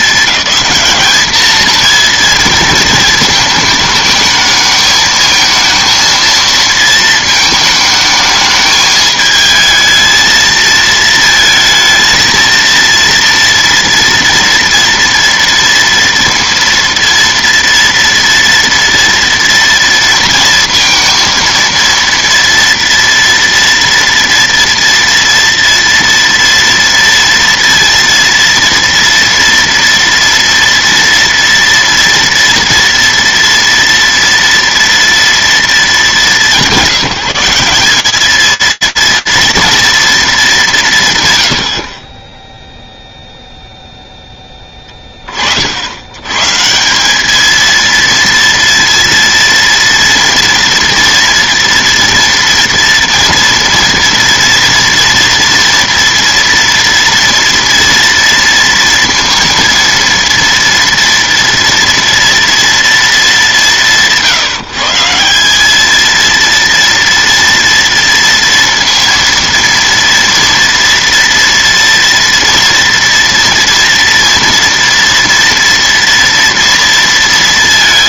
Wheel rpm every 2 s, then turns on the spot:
210, 220, 220, 230, 220, 220, 230, 230, 230, 230, 230, 230, 240, 230, 230, 230, 230, 230, 170, 230, 160, 0, 20, 200, 230, 230, 240, 230, 230, 230, 230, 220, 160, 230, 230, 230, 230, 230, 230.
none